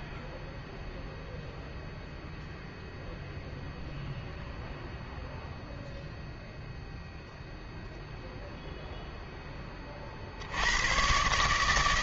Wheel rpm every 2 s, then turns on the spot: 0, 0, 0, 0, 0, 80.
none